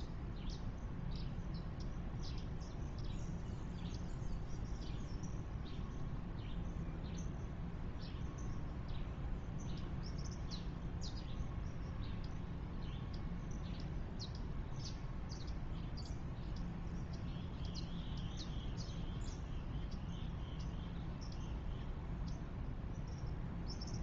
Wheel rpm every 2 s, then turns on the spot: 0, 0, 0, 0, 0, 0, 0, 0, 0, 0, 0, 0.
none